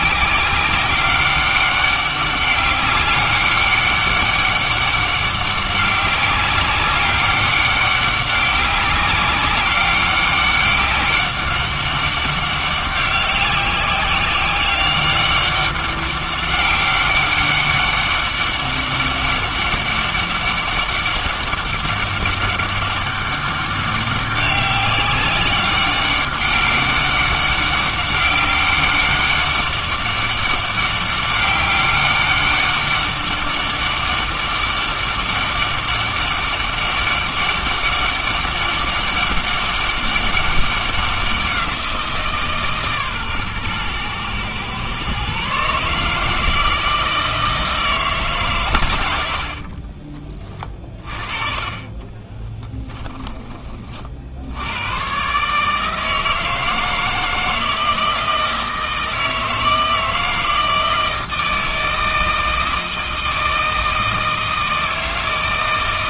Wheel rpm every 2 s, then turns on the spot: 190, 200, 200, 190, 190, 200, 190, 190, 200, 200, 200, 200, 200, 200, 200, 200, 200, 200, 200, 200, 200, 150, 120, 160, 120, 30, 10, 90, 160, 160, 160, 160, 160.
52-54